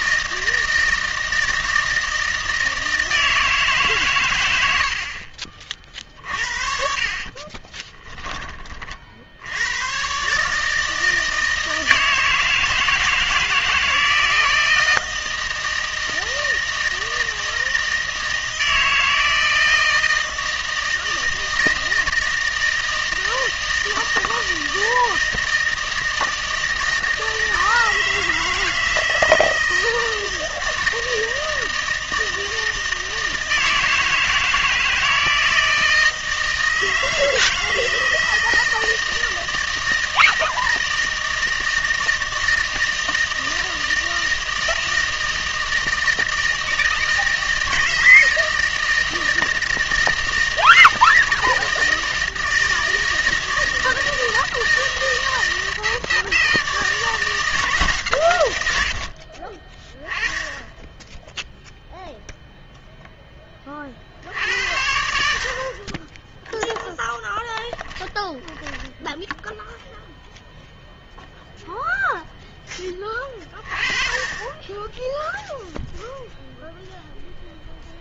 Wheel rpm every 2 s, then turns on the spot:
160, 160, 80, 50, 30, 150, 160, 160, 160, 160, 160, 160, 160, 160, 160, 160, 160, 160, 160, 160, 160, 160, 160, 160, 160, 160, 160, 170, 160, 90, 10, 0, 80, 10, 10, 0, 10, 10, 0.
66-70